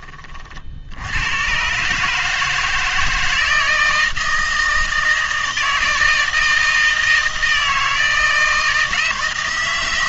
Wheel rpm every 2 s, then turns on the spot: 60, 160, 160, 160, 160.
none